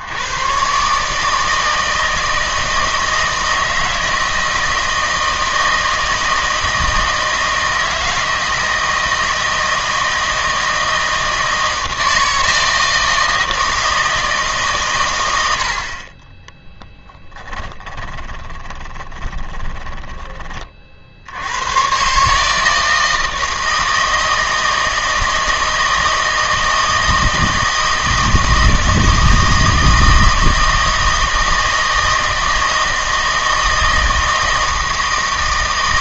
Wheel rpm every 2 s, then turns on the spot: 110, 160, 160, 160, 160, 160, 160, 140, 20, 20, 30, 150, 160, 160, 160, 160, 160, 160.
16-20